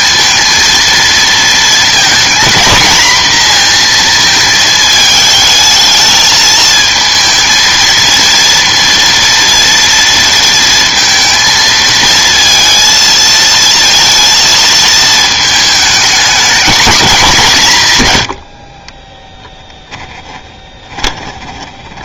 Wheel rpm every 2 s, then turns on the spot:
220, 230, 220, 220, 230, 230, 230, 230, 230, 70, 20.
20-22